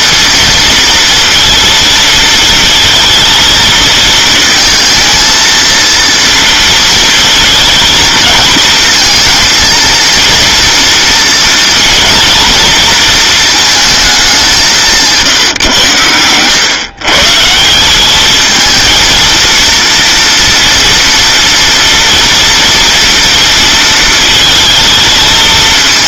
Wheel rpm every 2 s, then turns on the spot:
230, 220, 220, 230, 220, 230, 230, 200, 110, 220, 230, 230, 220.
none